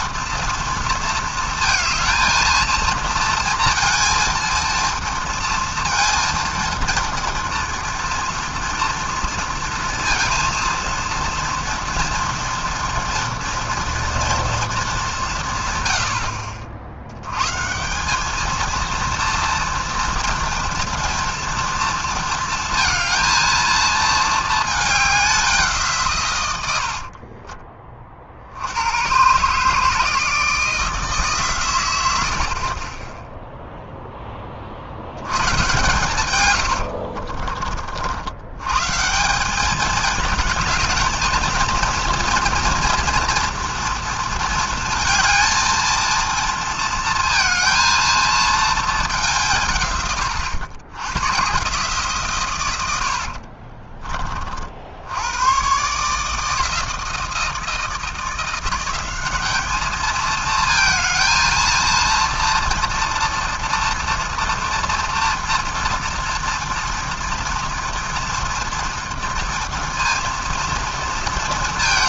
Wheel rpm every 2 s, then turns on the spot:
230, 230, 230, 230, 230, 230, 240, 220, 60, 230, 230, 230, 210, 80, 90, 160, 30, 50, 80, 130, 220, 230, 230, 230, 220, 90, 110, 60, 160, 180, 220, 230, 230, 230, 240, 230.
26-28 36-38